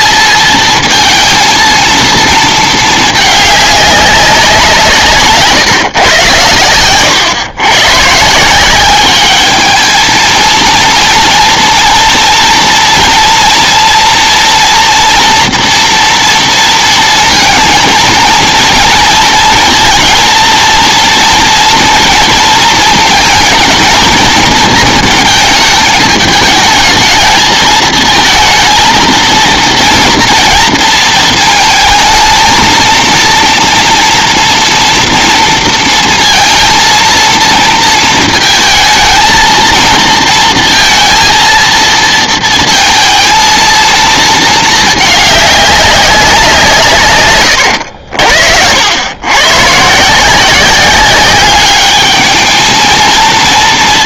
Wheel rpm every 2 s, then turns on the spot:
230, 220, 190, 120, 180, 230, 230, 230, 230, 230, 230, 230, 220, 210, 220, 230, 220, 230, 230, 230, 230, 230, 220, 160, 70, 180, 220.
none